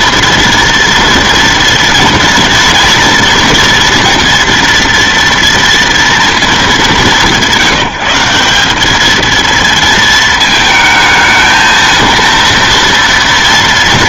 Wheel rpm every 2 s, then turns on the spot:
230, 230, 230, 190, 190, 220, 230.
none